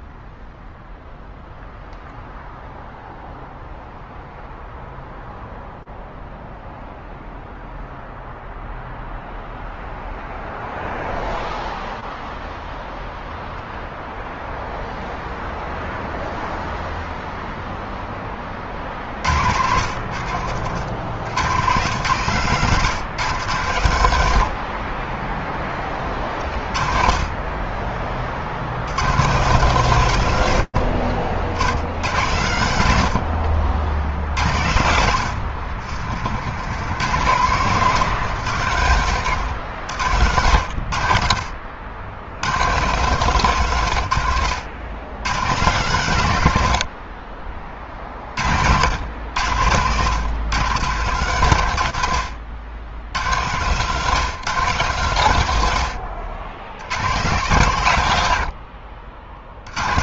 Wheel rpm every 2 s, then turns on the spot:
0, 0, 0, 0, 0, 0, 0, 0, 0, 0, 70, 130, 130, 10, 20, 150, 80, 70, 80, 140, 90, 70, 140, 140, 30, 100, 140, 130, 120, 90.
36-40